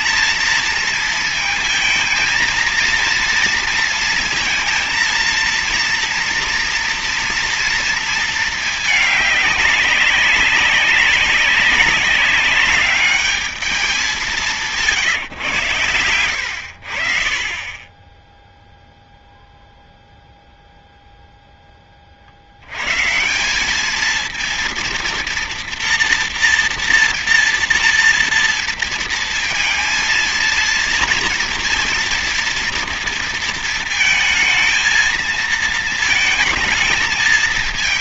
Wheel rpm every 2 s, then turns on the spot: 230, 230, 230, 240, 220, 190, 200, 180, 70, 0, 0, 110, 230, 230, 230, 230, 230, 230, 220.
none